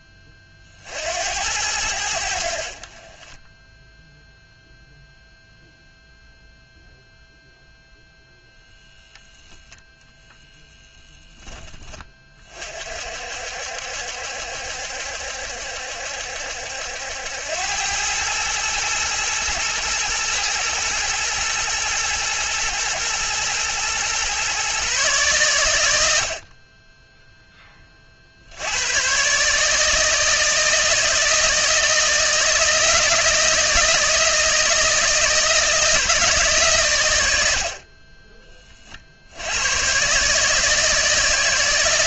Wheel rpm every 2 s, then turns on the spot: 60, 40, 0, 0, 0, 0, 50, 70, 80, 110, 110, 110, 130, 10, 100, 160, 160, 160, 130, 50, 160.
none